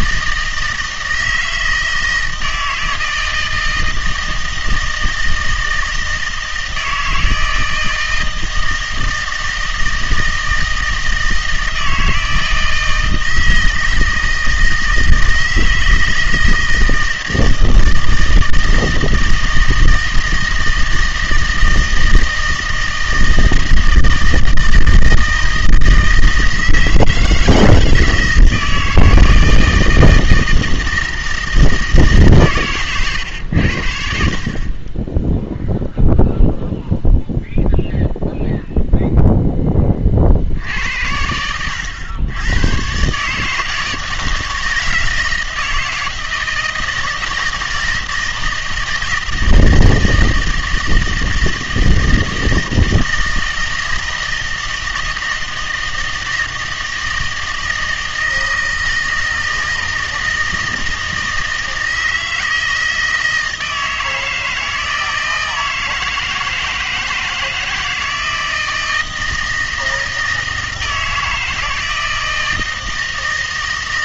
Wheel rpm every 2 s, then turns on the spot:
160, 160, 160, 160, 160, 160, 160, 160, 160, 160, 160, 160, 160, 160, 160, 160, 130, 30, 0, 0, 70, 110, 160, 160, 160, 160, 160, 160, 160, 160, 160, 160, 160, 160, 160, 160, 160.
none